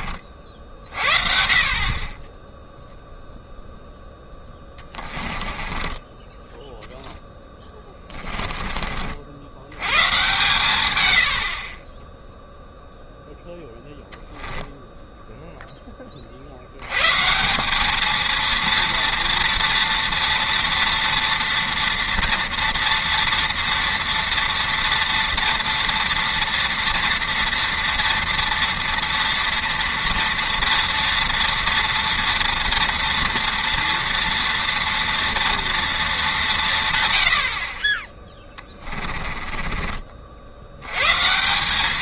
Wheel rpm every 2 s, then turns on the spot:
50, 0, 20, 10, 30, 120, 0, 0, 90, 230, 230, 230, 230, 230, 230, 230, 230, 230, 160, 20, 80.
4-6 38-40